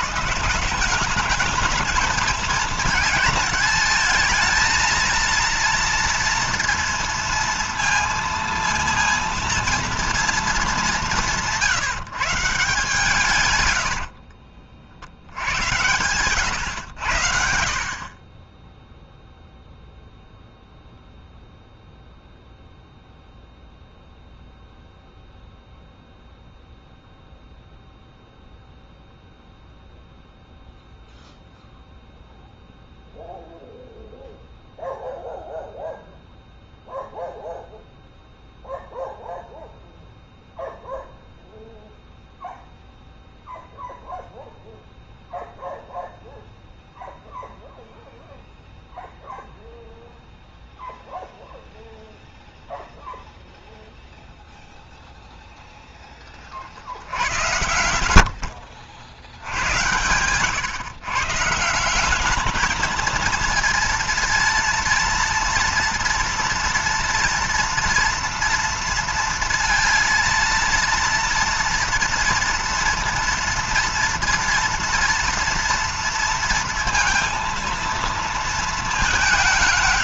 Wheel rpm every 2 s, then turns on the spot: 200, 220, 230, 230, 230, 200, 140, 70, 100, 0, 0, 0, 0, 0, 0, 0, 0, 0, 0, 0, 0, 0, 0, 0, 0, 0, 0, 0, 70, 80, 140, 230, 230, 240, 230, 230, 230, 230, 230, 190.
none